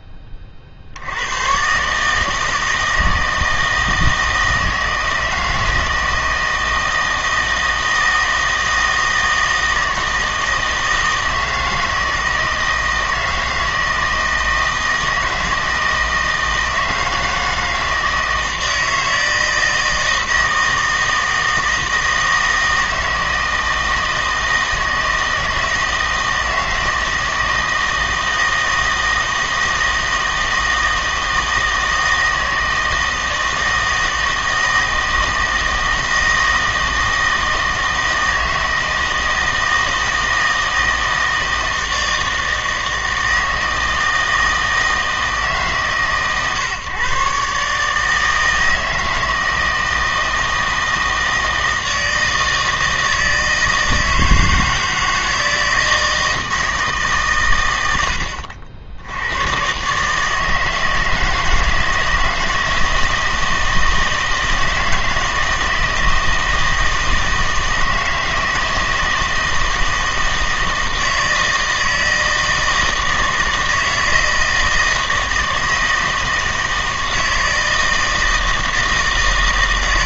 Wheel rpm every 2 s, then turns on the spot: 50, 160, 160, 160, 160, 160, 160, 160, 160, 160, 160, 160, 160, 160, 160, 160, 160, 160, 160, 160, 160, 160, 160, 140, 160, 160, 160, 160, 160, 70, 160, 160, 160, 160, 160, 160, 160, 160, 160, 160.
none